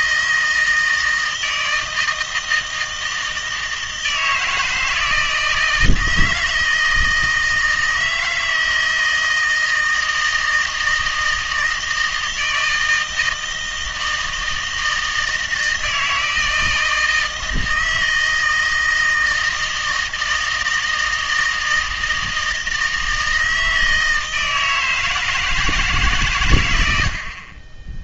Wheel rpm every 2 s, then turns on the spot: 160, 160, 160, 160, 160, 160, 160, 160, 160, 160, 160, 160, 160, 100.
none